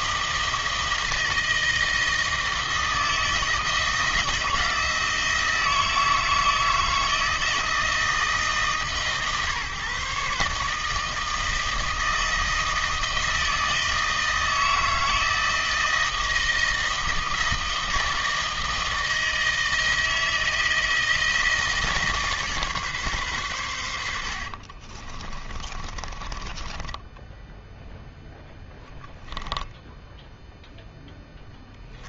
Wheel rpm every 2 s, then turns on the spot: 160, 160, 160, 160, 150, 150, 160, 160, 160, 160, 160, 150, 50, 20, 10, 0.
24-28